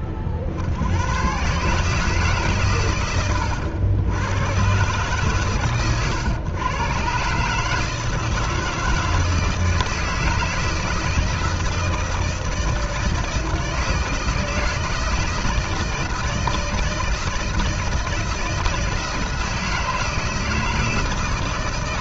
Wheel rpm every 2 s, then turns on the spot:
60, 140, 120, 120, 160, 160, 160, 160, 160, 160, 160.
none